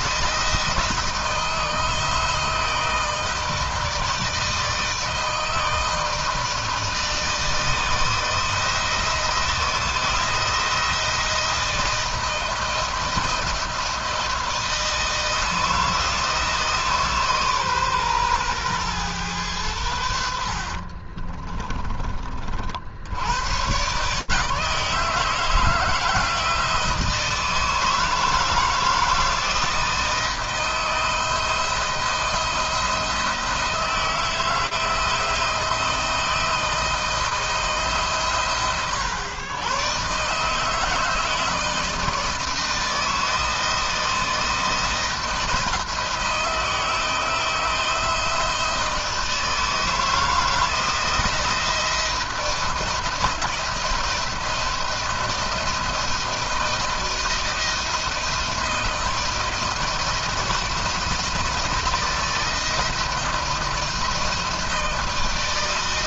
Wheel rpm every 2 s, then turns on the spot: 160, 160, 160, 160, 170, 160, 170, 170, 150, 120, 40, 80, 160, 170, 160, 160, 160, 160, 160, 100, 160, 160, 170, 160, 160, 160, 170, 160, 170, 160, 160, 160, 160.
20-22